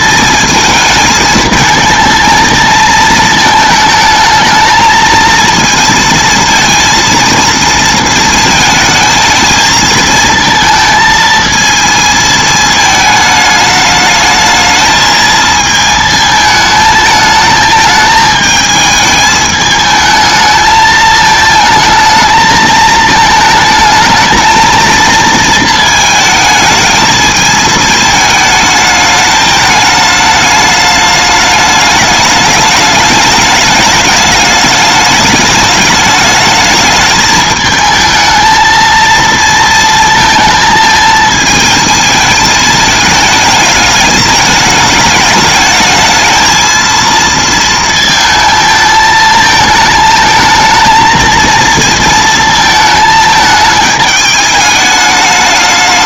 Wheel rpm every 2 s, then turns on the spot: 220, 220, 220, 230, 220, 220, 220, 220, 220, 220, 220, 220, 230, 220, 210, 210, 210, 210, 220, 220, 220, 220, 210, 220, 220, 220, 220, 210.
none